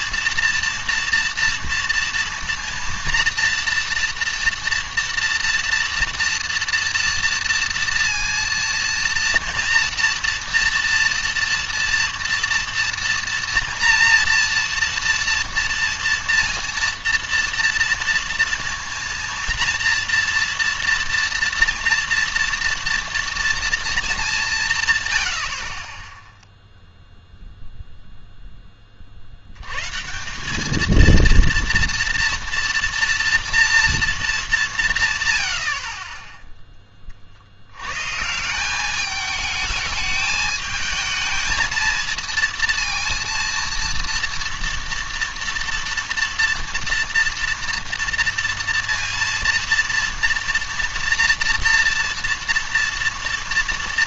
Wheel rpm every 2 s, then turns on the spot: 230, 230, 230, 230, 230, 230, 230, 230, 230, 230, 230, 230, 160, 0, 20, 210, 230, 180, 10, 190, 220, 230, 230, 230, 230, 230, 230.
none